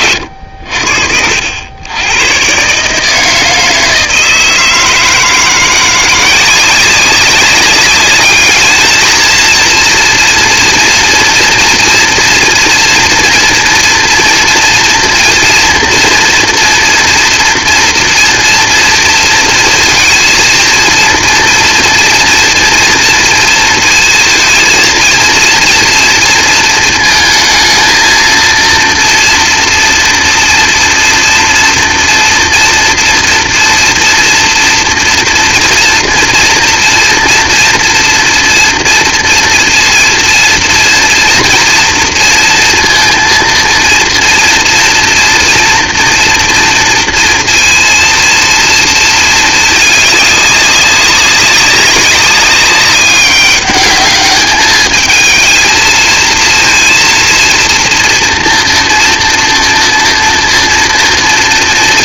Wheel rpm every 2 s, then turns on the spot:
60, 140, 160, 180, 210, 230, 230, 240, 230, 230, 230, 230, 230, 230, 230, 230, 230, 230, 230, 230, 230, 230, 230, 230, 230, 200, 200, 210, 230, 240, 230.
none